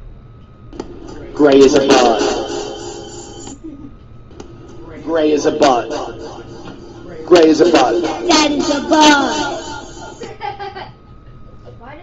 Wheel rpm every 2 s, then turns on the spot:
0, 0, 0, 0, 0, 0.
none